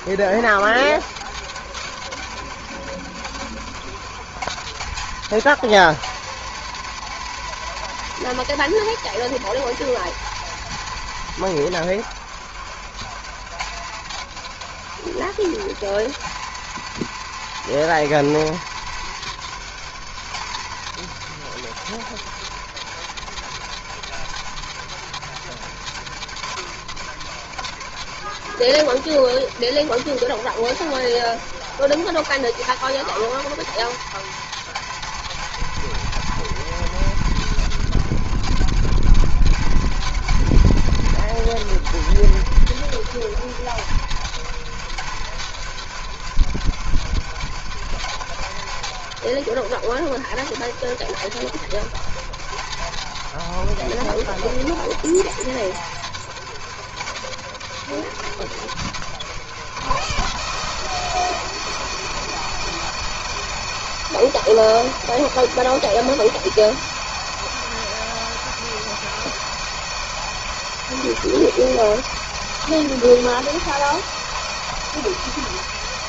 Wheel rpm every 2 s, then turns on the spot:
180, 170, 180, 220, 230, 230, 190, 190, 210, 220, 200, 170, 170, 170, 170, 180, 200, 230, 230, 180, 220, 210, 200, 180, 180, 170, 190, 180, 190, 170, 160, 170, 170, 170, 170, 170, 170, 170.
none